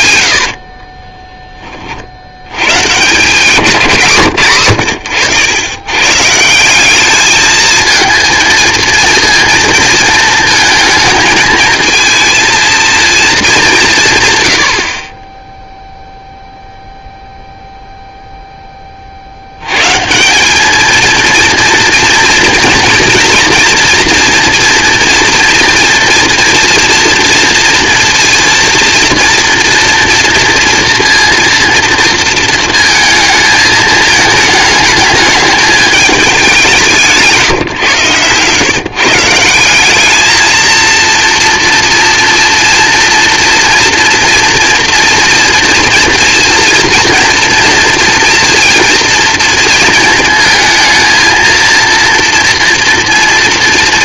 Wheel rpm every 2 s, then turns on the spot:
80, 80, 110, 160, 230, 220, 230, 130, 0, 10, 180, 230, 230, 230, 230, 230, 230, 210, 200, 120, 220, 230, 230, 230, 230, 230, 230.
0-2